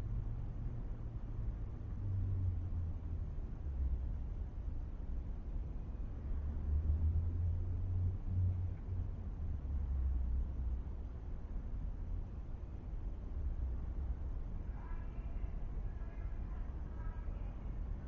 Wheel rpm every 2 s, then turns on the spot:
0, 0, 0, 0, 0, 0, 0, 0, 0.
none